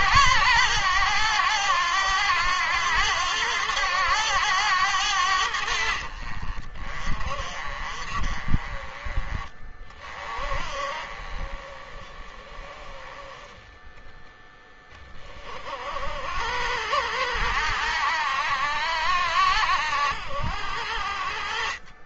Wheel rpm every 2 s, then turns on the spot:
100, 100, 90, 40, 30, 30, 20, 10, 80, 70, 60.
none